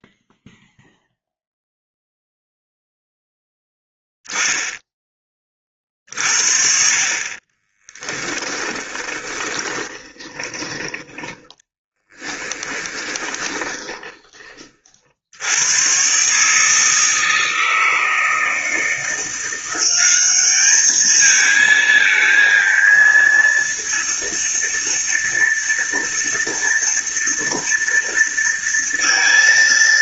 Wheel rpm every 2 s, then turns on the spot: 0, 0, 10, 40, 20, 20, 10, 50, 160, 160, 210, 230, 230, 230, 230.
8-10 12-14